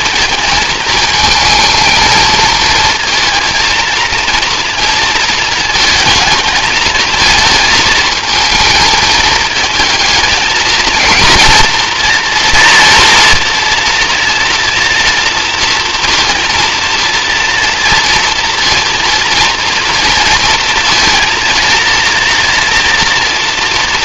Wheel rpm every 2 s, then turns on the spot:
220, 230, 230, 220, 220, 230, 240, 230, 230, 230, 230, 230.
none